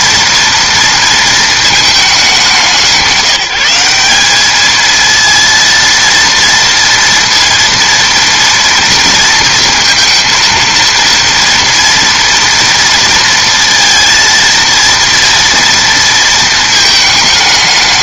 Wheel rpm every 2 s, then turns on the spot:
230, 190, 220, 230, 230, 230, 230, 230, 220.
none